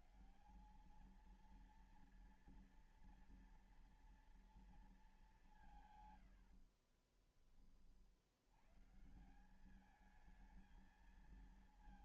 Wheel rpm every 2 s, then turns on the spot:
170, 230, 230, 100, 80, 220.
6-8